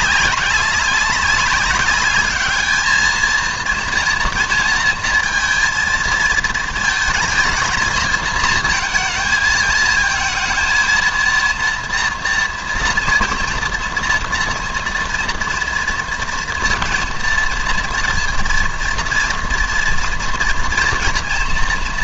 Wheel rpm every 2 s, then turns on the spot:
200, 220, 230, 220, 230, 220, 230, 230, 230, 240, 230.
none